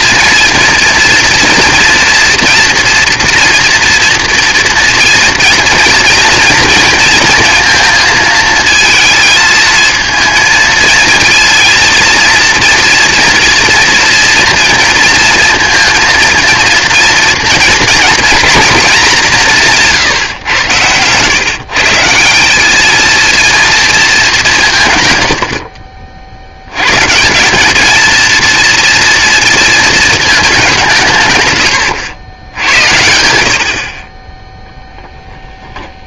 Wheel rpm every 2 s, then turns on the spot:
230, 230, 230, 230, 220, 230, 230, 230, 230, 220, 110, 210, 160, 110, 230, 180, 80, 0.
20-22